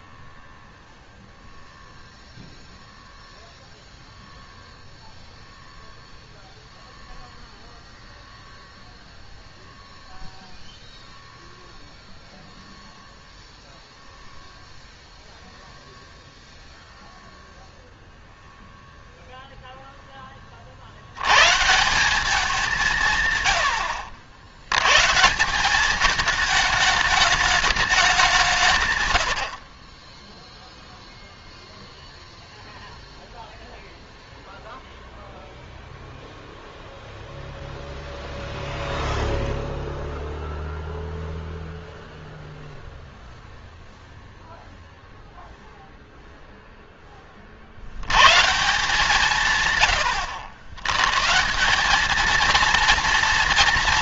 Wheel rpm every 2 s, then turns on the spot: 0, 0, 0, 0, 0, 0, 0, 0, 0, 0, 100, 150, 150, 210, 80, 0, 0, 0, 0, 0, 0, 0, 0, 10, 170, 120, 230.
none